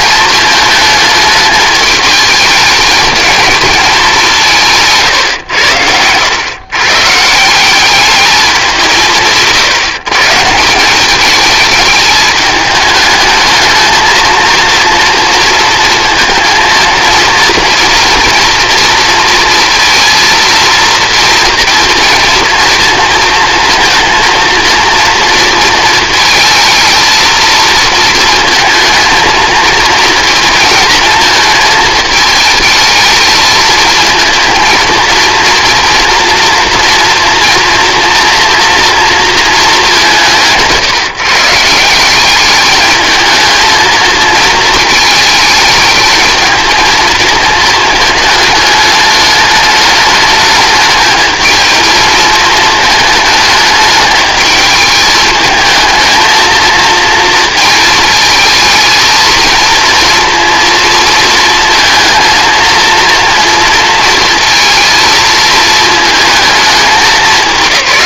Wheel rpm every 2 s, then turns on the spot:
210, 220, 110, 160, 160, 210, 210, 230, 230, 230, 230, 230, 230, 220, 230, 220, 220, 230, 230, 230, 150, 220, 220, 220, 210, 220, 220, 210, 230, 220, 220, 230, 230, 210.
4-6